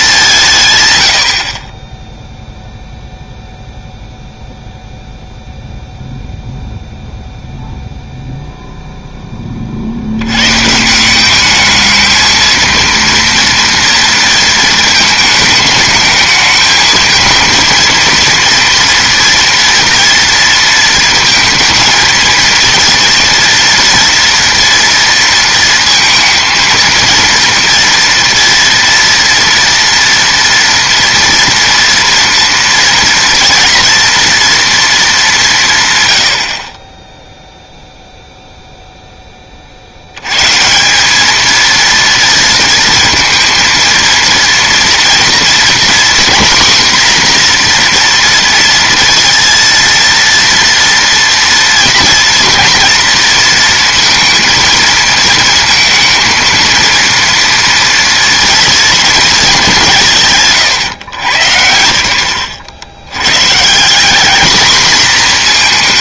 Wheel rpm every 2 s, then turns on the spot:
150, 0, 0, 0, 0, 140, 230, 220, 220, 230, 230, 230, 230, 220, 230, 230, 230, 230, 50, 0, 150, 230, 230, 240, 230, 230, 230, 230, 230, 230, 140, 90, 230.
none